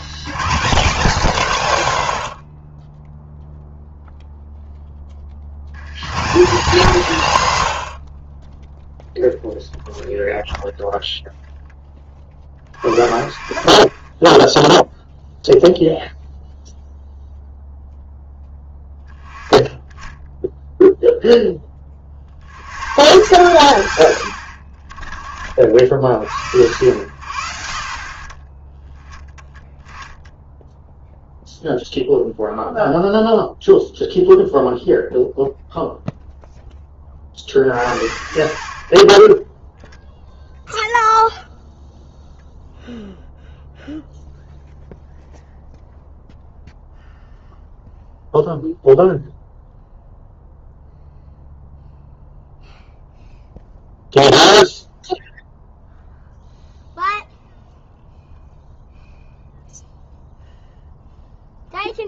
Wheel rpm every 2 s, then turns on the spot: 160, 50, 0, 190, 20, 10, 40, 0, 0, 10, 0, 90, 70, 80, 10, 0, 0, 0, 0, 30, 0, 0, 0, 0, 0, 0, 0, 0, 0, 0, 0.
none